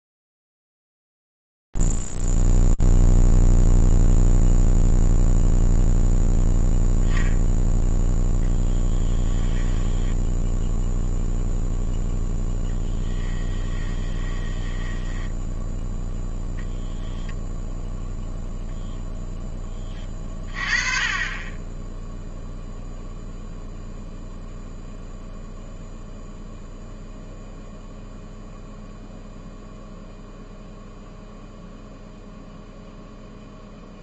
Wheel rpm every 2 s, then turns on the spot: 0, 0, 0, 0, 0, 10, 0, 10, 10, 0, 20, 0, 0, 0, 0, 0, 0.
14-16